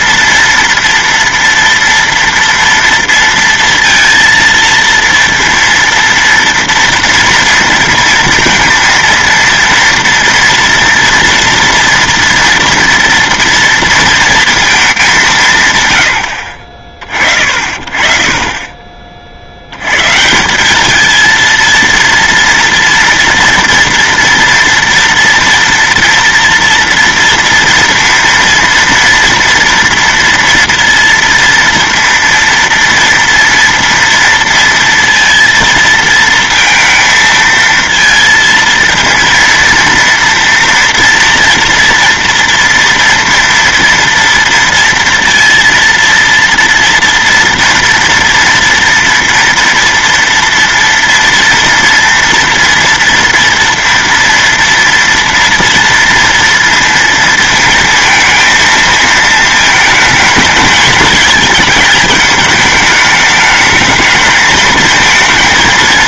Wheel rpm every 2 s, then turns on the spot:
230, 230, 230, 230, 230, 230, 230, 200, 50, 30, 210, 230, 240, 230, 230, 230, 230, 230, 230, 230, 230, 230, 230, 230, 230, 240, 230, 230, 230, 220, 220, 220, 230.
none